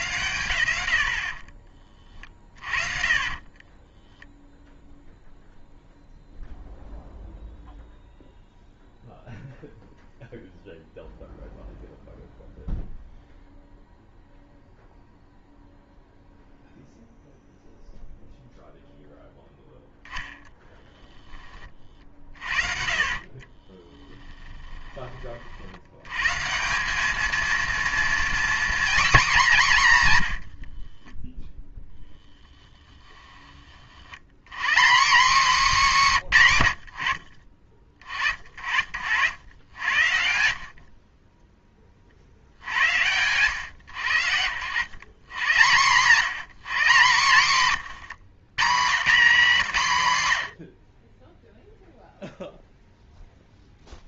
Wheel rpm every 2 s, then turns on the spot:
80, 40, 0, 0, 0, 0, 0, 0, 0, 0, 10, 40, 20, 180, 250, 50, 10, 180, 110, 50, 50, 80, 110, 170, 170, 60, 0.
2-4 22-24 30-32